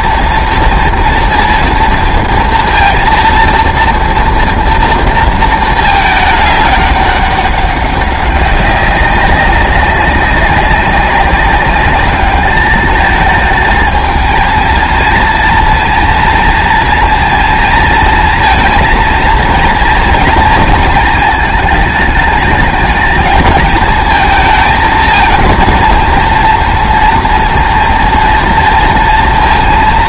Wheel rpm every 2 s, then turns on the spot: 230, 230, 230, 210, 190, 190, 210, 230, 230, 230, 220, 220, 220, 230, 230.
none